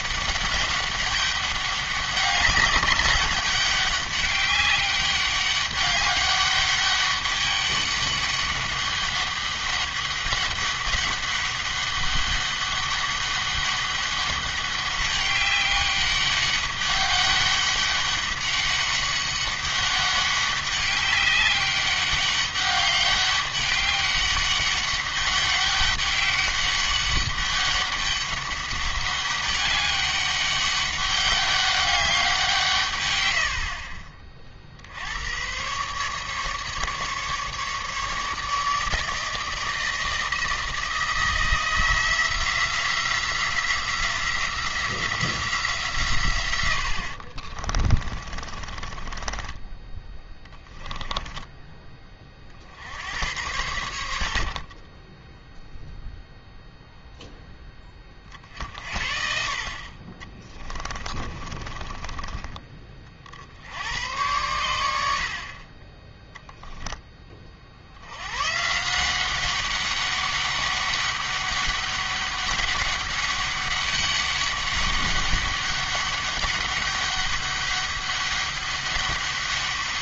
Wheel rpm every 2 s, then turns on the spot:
200, 200, 200, 200, 200, 200, 200, 200, 200, 200, 200, 200, 200, 200, 200, 200, 160, 50, 140, 150, 160, 170, 180, 90, 30, 10, 60, 30, 0, 50, 20, 30, 100, 10, 150, 200, 200, 200, 200, 200.
48-52 60-62